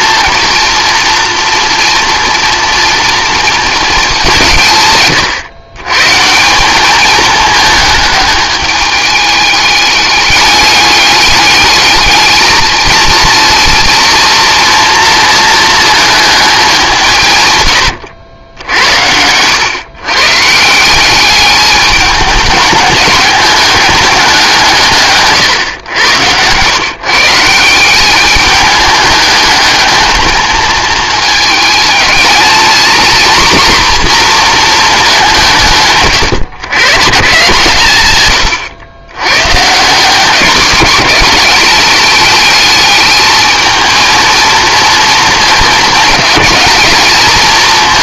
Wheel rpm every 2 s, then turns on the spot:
230, 230, 150, 180, 210, 210, 220, 230, 200, 80, 160, 210, 170, 120, 210, 220, 220, 230, 110, 110, 190, 220, 230, 220.
none